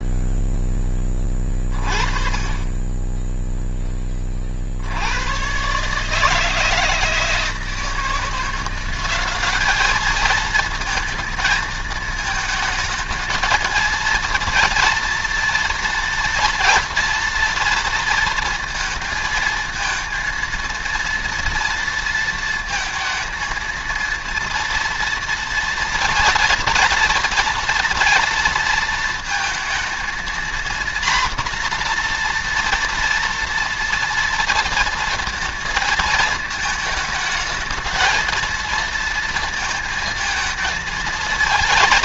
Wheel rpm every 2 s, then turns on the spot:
10, 20, 60, 160, 180, 220, 220, 230, 230, 230, 230, 230, 230, 230, 230, 240, 240, 230, 220, 230, 220.
none